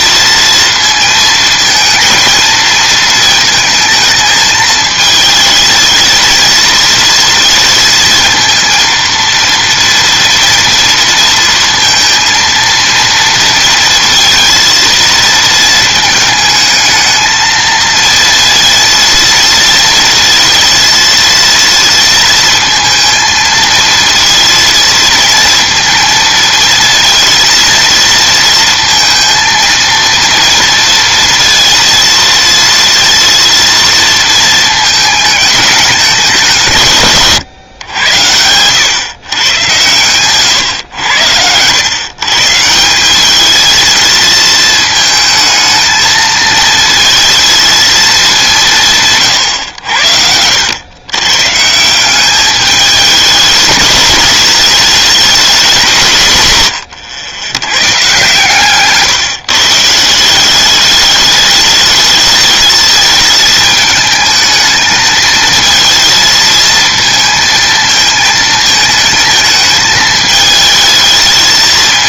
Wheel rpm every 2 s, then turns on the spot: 230, 220, 220, 230, 230, 230, 230, 230, 220, 230, 230, 230, 230, 230, 230, 230, 230, 220, 150, 130, 100, 180, 220, 230, 150, 100, 210, 210, 120, 150, 200, 220, 220, 220, 220, 220.
56-58